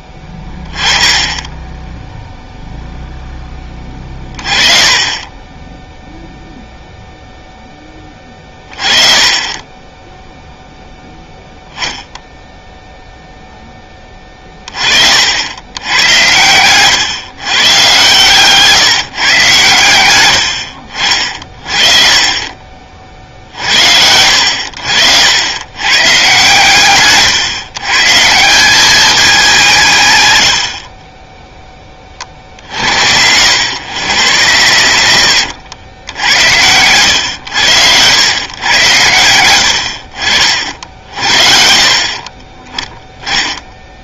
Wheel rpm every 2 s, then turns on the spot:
20, 0, 20, 0, 20, 0, 0, 30, 120, 160, 60, 40, 70, 130, 190, 70, 70, 110, 90, 120, 60, 20.
none